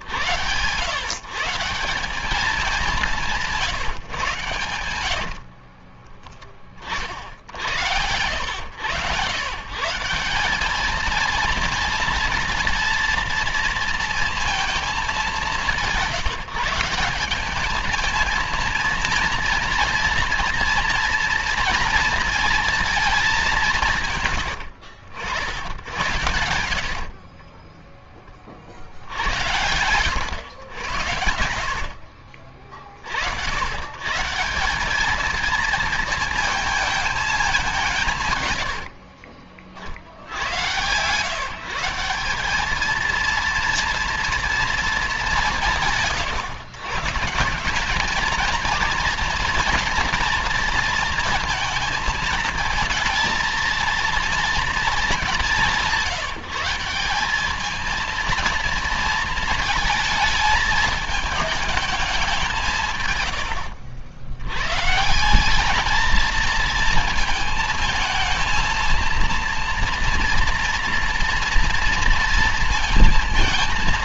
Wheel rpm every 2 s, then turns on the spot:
130, 190, 120, 30, 110, 200, 230, 230, 180, 230, 240, 230, 110, 80, 50, 100, 40, 180, 230, 120, 90, 200, 230, 140, 230, 230, 230, 230, 180, 230, 220, 180, 110, 230, 220, 230, 230.
4-6 28-30